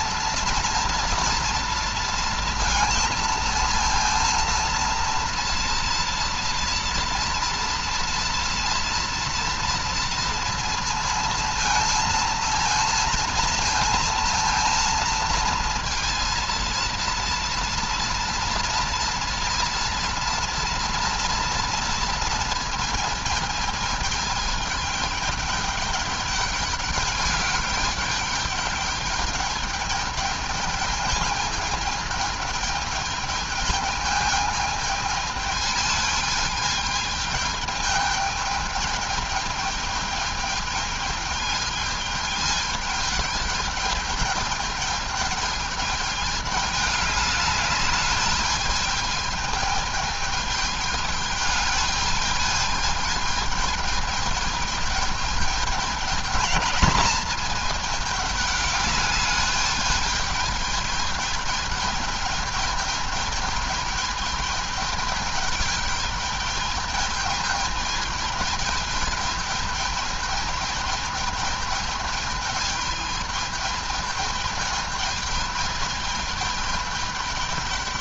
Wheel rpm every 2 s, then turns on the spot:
230, 230, 230, 230, 230, 230, 230, 230, 230, 230, 230, 220, 210, 210, 210, 210, 210, 210, 210, 210, 210, 210, 210, 210, 210, 210, 210, 210, 210, 210, 210, 210, 210, 210, 210, 210, 210, 210, 210.
none